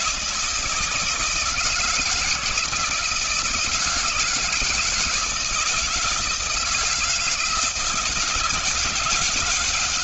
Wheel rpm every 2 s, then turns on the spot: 160, 170, 160, 160, 160.
none